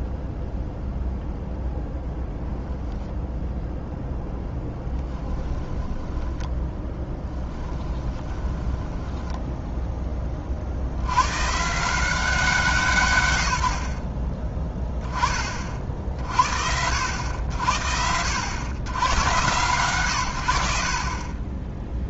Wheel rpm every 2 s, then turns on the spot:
0, 0, 10, 10, 10, 70, 150, 10, 80, 110, 80.
4-10